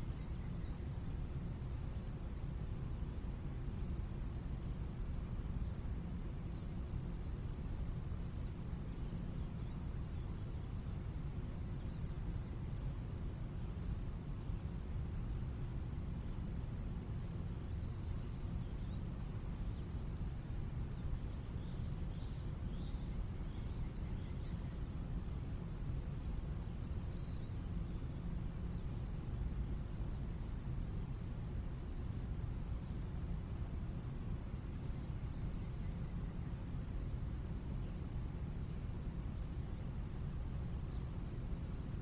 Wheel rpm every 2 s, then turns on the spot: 0, 0, 0, 0, 0, 0, 0, 0, 0, 0, 0, 0, 0, 0, 0, 0, 0, 0, 0, 0, 0.
none